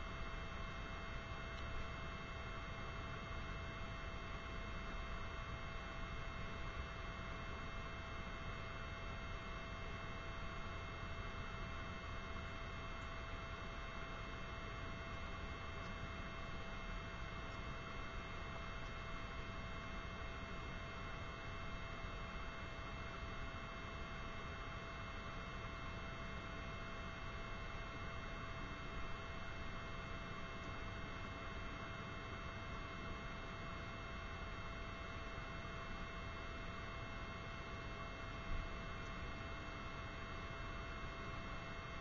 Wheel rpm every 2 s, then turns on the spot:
0, 0, 0, 0, 0, 0, 0, 0, 0, 0, 0, 0, 0, 0, 0, 0, 0, 0, 0, 0, 0.
none